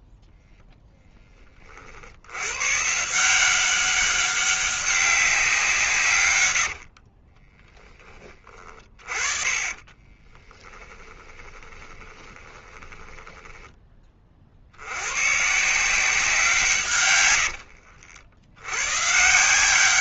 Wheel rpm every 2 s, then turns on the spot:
10, 140, 200, 70, 30, 10, 20, 90, 140, 120.
6-8 10-14